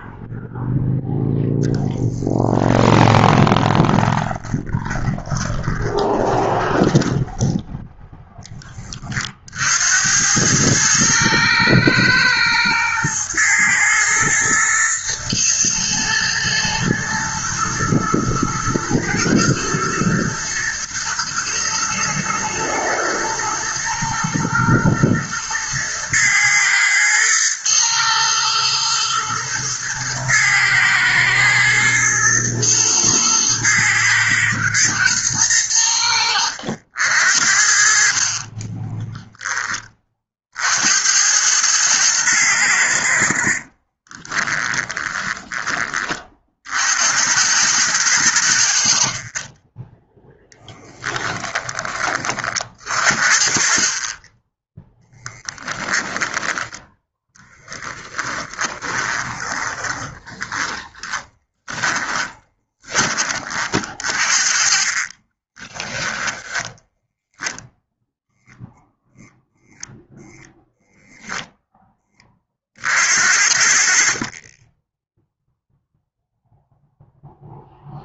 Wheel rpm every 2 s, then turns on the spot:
0, 10, 20, 20, 30, 110, 120, 120, 110, 110, 120, 120, 120, 110, 120, 110, 110, 110, 70, 20, 70, 80, 20, 70, 60, 20, 50, 10, 10, 30, 20, 20, 40, 10, 0, 0, 50, 10, 0.
2-6 38-40 44-46 50-52 54-56 58-62 64-66